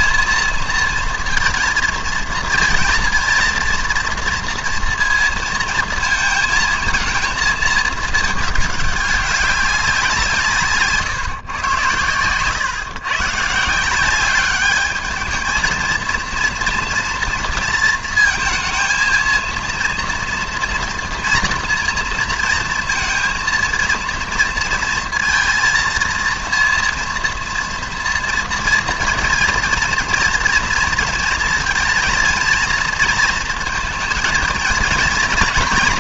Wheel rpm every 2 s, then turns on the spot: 230, 230, 230, 220, 210, 170, 120, 200, 230, 220, 240, 230, 230, 230, 230, 230, 220, 220.
none